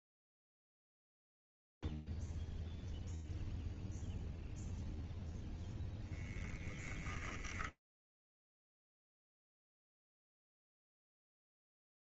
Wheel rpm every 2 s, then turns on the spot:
0, 0, 0, 0, 10, 10.
none